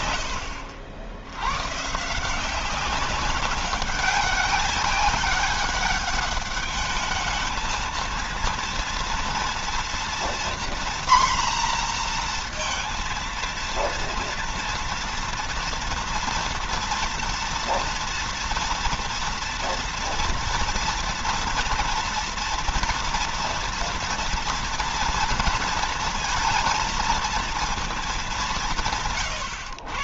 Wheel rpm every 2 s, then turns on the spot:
80, 190, 200, 210, 230, 240, 230, 230, 240, 230, 230, 230, 230, 230, 140.
none